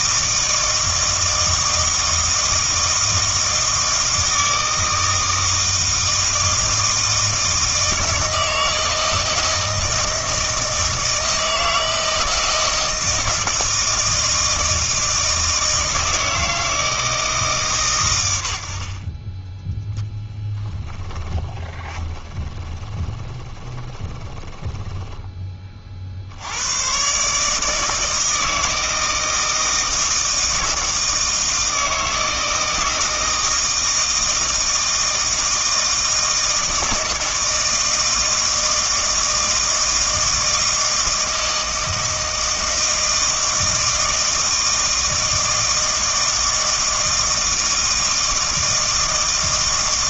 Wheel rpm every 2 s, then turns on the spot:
160, 160, 160, 160, 160, 160, 160, 160, 160, 70, 10, 20, 10, 110, 160, 160, 160, 160, 160, 160, 160, 160, 160, 160, 160.
20-26